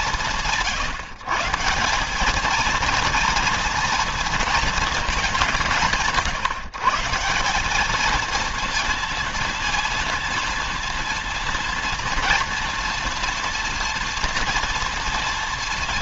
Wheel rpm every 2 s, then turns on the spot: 150, 210, 220, 150, 230, 230, 230, 240.
none